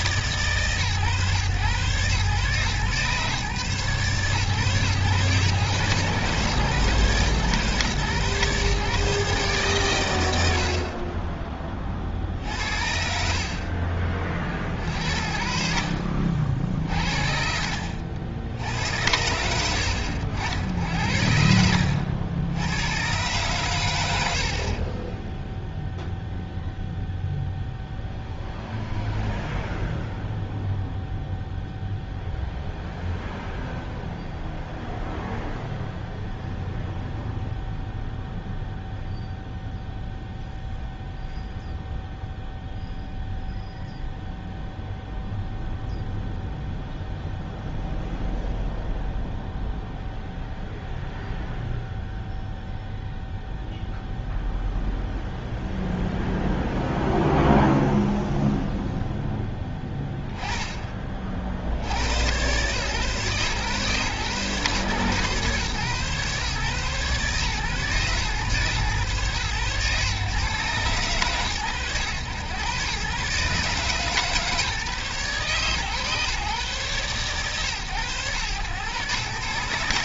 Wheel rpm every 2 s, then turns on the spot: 130, 130, 120, 130, 140, 40, 60, 50, 60, 80, 80, 110, 40, 0, 0, 0, 0, 0, 0, 0, 0, 0, 0, 0, 0, 0, 0, 0, 0, 0, 20, 130, 130, 130, 120, 110, 120, 150, 130, 120.
none